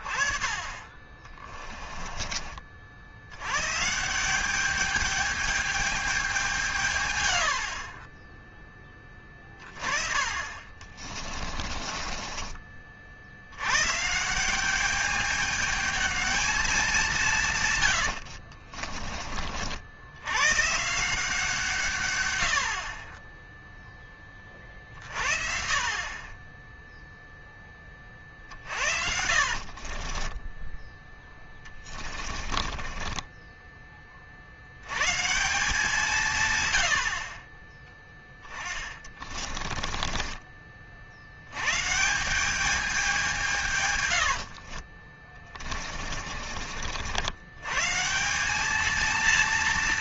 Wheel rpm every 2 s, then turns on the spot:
30, 50, 200, 170, 30, 40, 40, 190, 210, 40, 140, 60, 30, 10, 60, 20, 30, 90, 120, 20, 40, 200, 60, 60, 200.
0-2 10-12 18-20 28-34 38-40 44-46